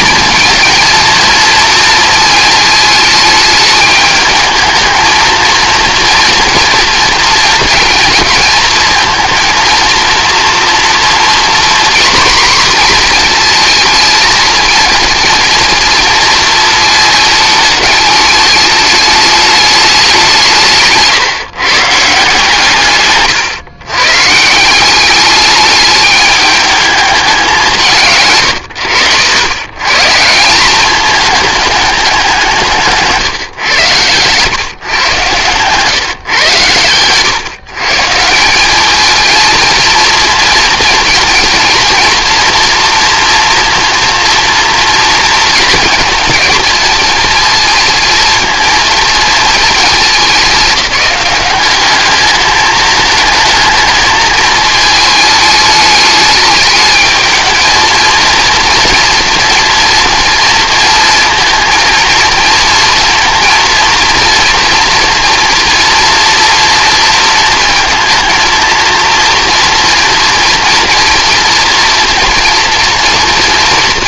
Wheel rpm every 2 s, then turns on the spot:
230, 220, 220, 230, 220, 240, 240, 230, 220, 210, 150, 130, 190, 210, 80, 210, 150, 120, 110, 210, 230, 240, 230, 220, 230, 190, 220, 220, 210, 230, 230, 230, 230, 230, 230, 230, 240.
none